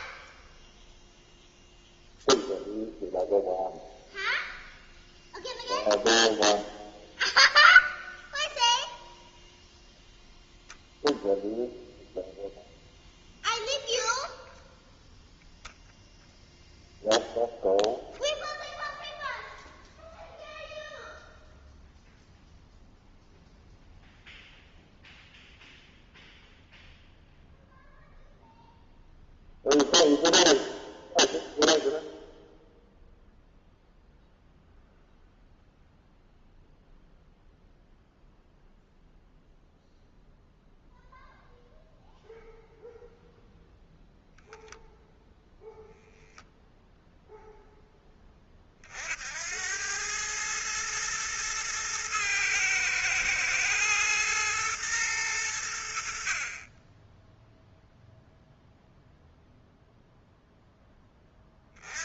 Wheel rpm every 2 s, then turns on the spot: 0, 0, 0, 0, 0, 0, 0, 0, 0, 0, 0, 0, 0, 0, 0, 0, 0, 0, 0, 0, 0, 0, 0, 0, 50, 110, 110, 110, 20, 0, 0.
none